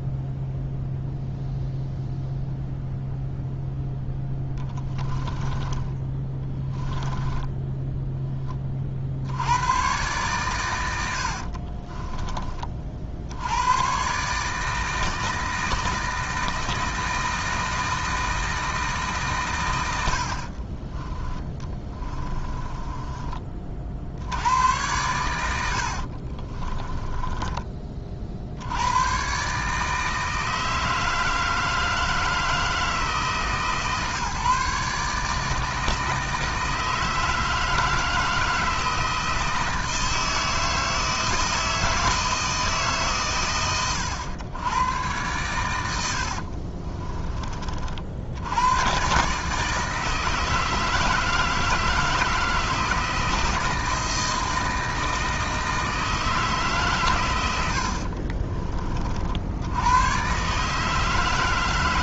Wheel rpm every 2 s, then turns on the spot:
0, 0, 10, 10, 40, 100, 40, 160, 160, 160, 30, 20, 90, 20, 90, 160, 160, 150, 160, 160, 160, 150, 100, 40, 110, 160, 160, 160, 140, 40, 150.
4-8 20-24 26-28 46-48